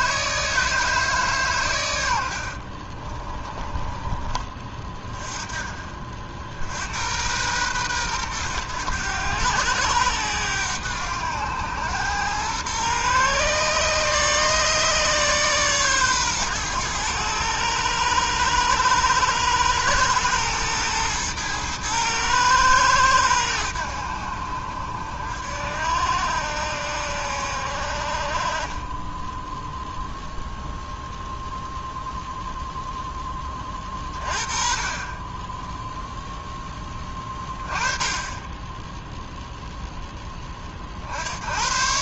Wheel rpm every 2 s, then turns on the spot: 150, 40, 40, 100, 110, 100, 130, 150, 110, 100, 110, 100, 60, 70, 10, 0, 10, 20, 10, 0, 60.
2-4